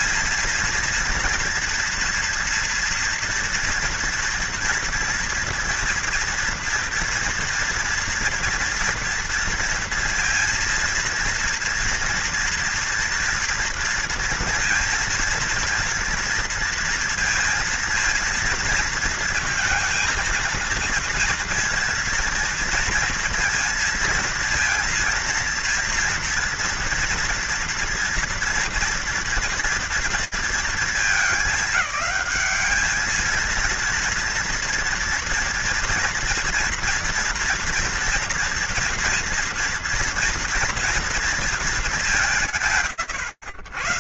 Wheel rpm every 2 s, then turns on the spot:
230, 230, 230, 230, 230, 230, 230, 230, 230, 230, 230, 230, 230, 240, 230, 230, 210, 240, 230, 230, 230, 160.
none